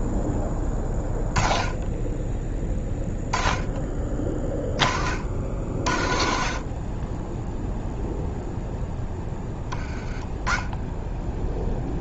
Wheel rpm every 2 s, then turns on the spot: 10, 10, 30, 40, 0, 20.
none